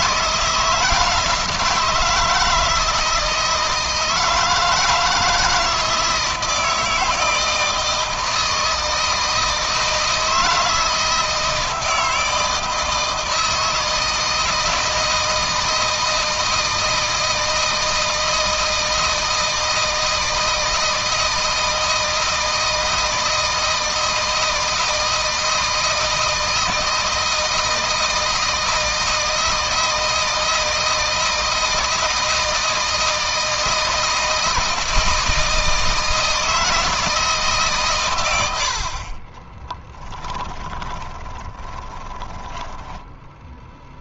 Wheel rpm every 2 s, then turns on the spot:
160, 160, 160, 160, 160, 160, 160, 160, 160, 160, 160, 160, 160, 160, 160, 160, 160, 160, 160, 50, 20, 10.
40-44